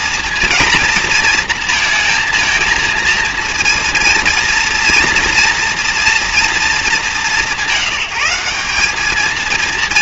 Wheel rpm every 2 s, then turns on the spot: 220, 230, 230, 200, 220.
none